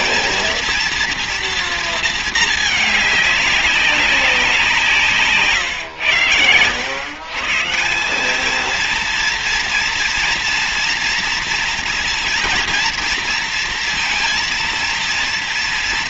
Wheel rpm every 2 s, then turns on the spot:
230, 220, 180, 110, 220, 230, 230, 230.
none